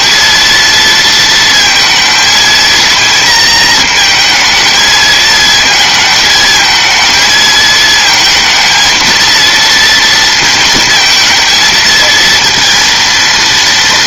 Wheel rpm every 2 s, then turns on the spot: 230, 230, 220, 220, 230, 230, 230.
none